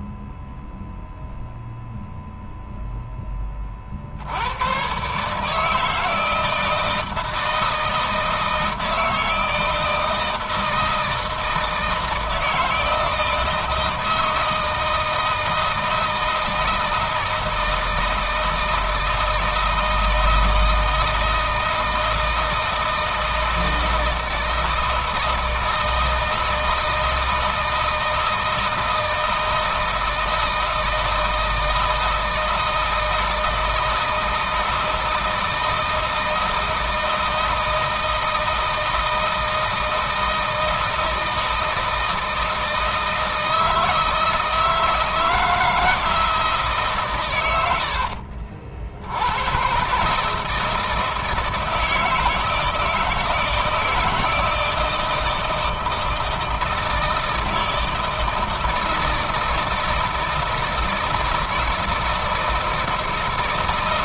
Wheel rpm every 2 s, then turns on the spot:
0, 0, 110, 160, 160, 160, 160, 160, 160, 160, 160, 160, 160, 160, 160, 160, 160, 160, 160, 160, 160, 160, 160, 150, 60, 160, 160, 160, 160, 160, 160, 160.
none